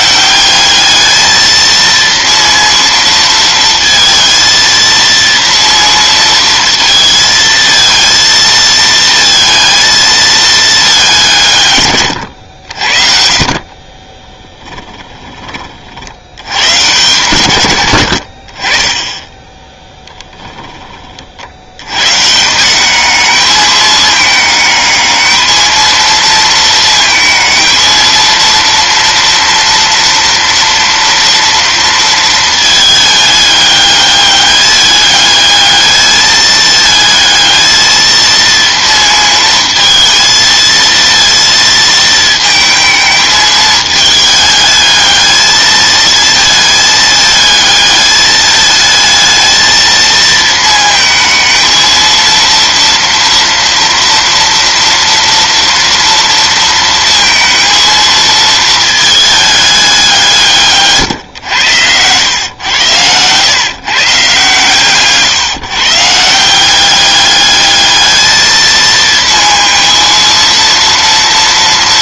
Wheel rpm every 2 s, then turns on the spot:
210, 230, 230, 230, 230, 210, 60, 10, 120, 20, 30, 190, 210, 220, 230, 230, 220, 210, 220, 230, 230, 220, 210, 220, 220, 220, 230, 230, 230, 220, 140, 110, 150, 190, 230, 230.
64-66